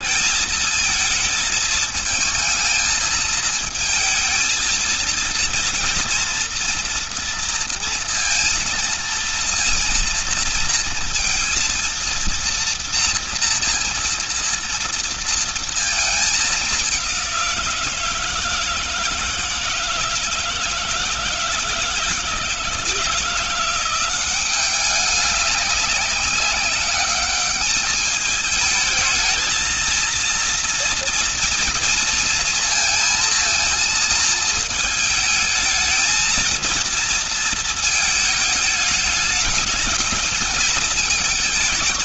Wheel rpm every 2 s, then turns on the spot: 220, 220, 230, 230, 230, 230, 230, 230, 200, 160, 160, 160, 200, 200, 210, 230, 230, 220, 230, 210, 220.
none